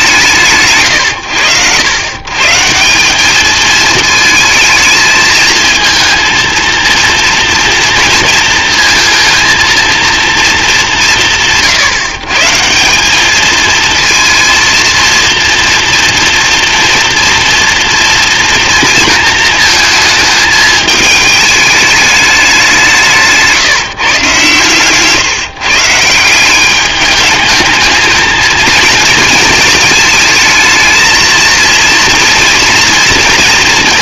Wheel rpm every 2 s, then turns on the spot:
120, 150, 220, 230, 230, 190, 170, 230, 230, 230, 220, 180, 130, 200, 220, 220, 230.
none